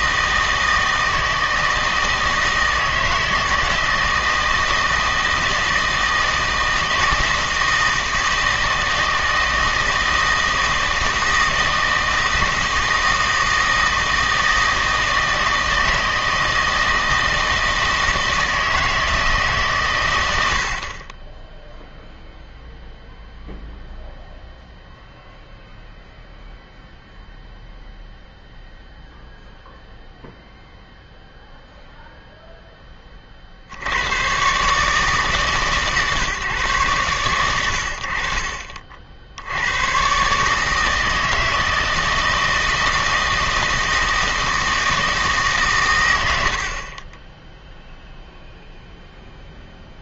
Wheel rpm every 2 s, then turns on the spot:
160, 160, 160, 160, 160, 160, 160, 160, 160, 160, 60, 0, 0, 0, 0, 0, 10, 140, 130, 50, 160, 160, 160, 70, 0.
none